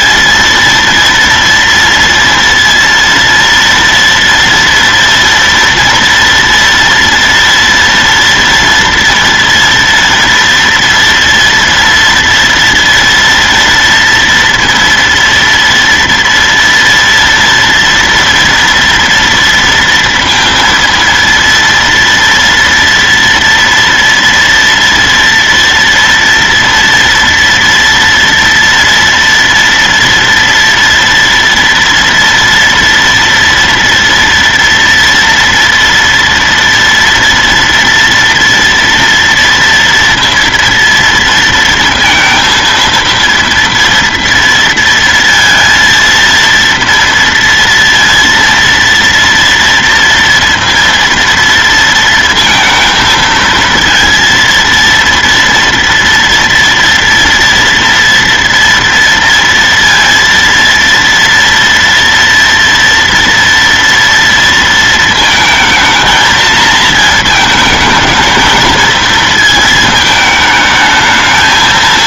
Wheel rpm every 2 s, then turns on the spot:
230, 230, 230, 230, 230, 240, 230, 230, 230, 230, 230, 230, 230, 230, 240, 230, 230, 230, 240, 230, 230, 230, 230, 230, 230, 230, 220, 230, 230, 230, 230, 230, 230, 220, 220, 220.
none